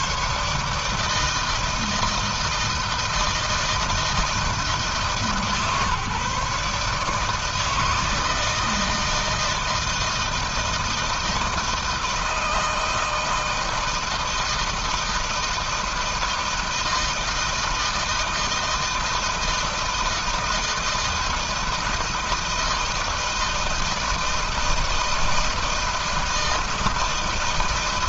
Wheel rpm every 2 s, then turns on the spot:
140, 160, 160, 150, 160, 160, 160, 160, 160, 160, 160, 160, 160, 160.
none